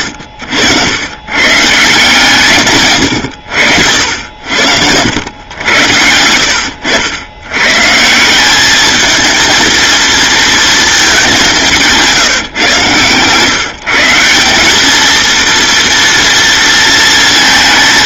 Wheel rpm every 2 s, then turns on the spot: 90, 120, 80, 80, 210, 220, 130, 210, 230.
none